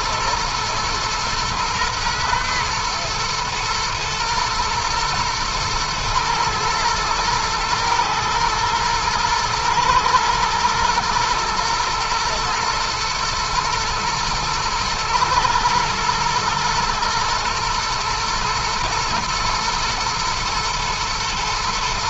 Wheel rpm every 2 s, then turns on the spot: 110, 120, 120, 120, 110, 110, 110, 110, 110, 110, 110.
none